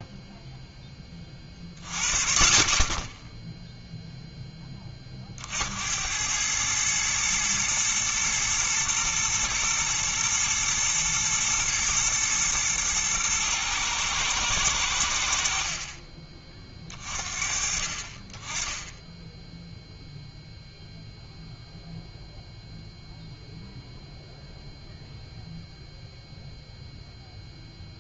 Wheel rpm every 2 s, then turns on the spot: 0, 40, 10, 100, 120, 120, 120, 100, 40, 20, 0, 0, 0, 0.
none